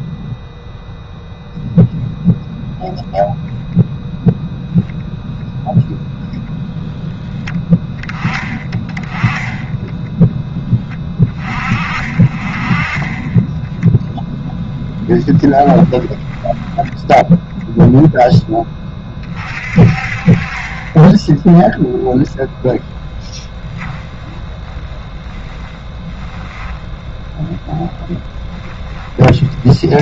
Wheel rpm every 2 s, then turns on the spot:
0, 0, 0, 0, 10, 10, 30, 10, 10, 10, 30, 0, 20, 10, 10.
14-18 24-30